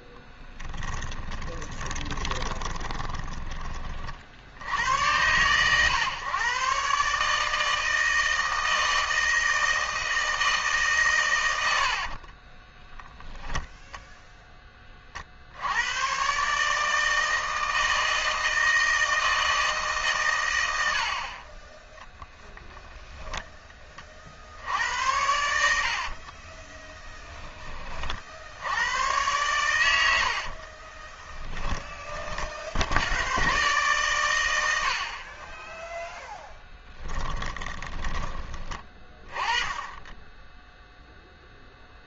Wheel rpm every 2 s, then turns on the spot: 10, 20, 100, 140, 160, 140, 10, 30, 150, 160, 80, 0, 80, 10, 100, 20, 80, 60, 10, 20, 0.
0-4 12-14 26-28 30-32 36-38